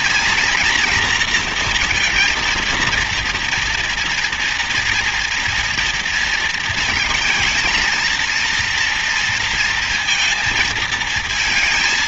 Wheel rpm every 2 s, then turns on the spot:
230, 230, 240, 230, 230, 230.
none